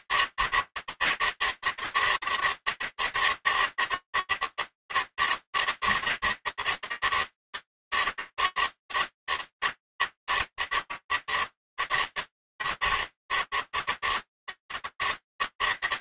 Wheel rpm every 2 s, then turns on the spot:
160, 160, 160, 160, 160, 150, 150, 160.
none